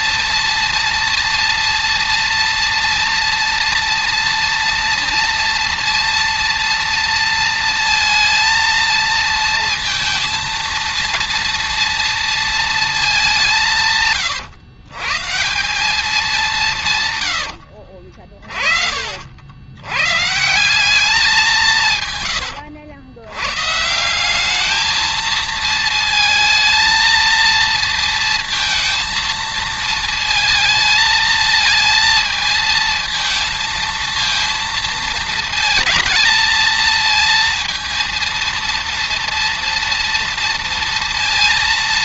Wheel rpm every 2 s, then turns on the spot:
230, 230, 230, 230, 230, 230, 210, 150, 150, 60, 190, 90, 220, 230, 230, 220, 220, 230, 230, 230, 230.
16-18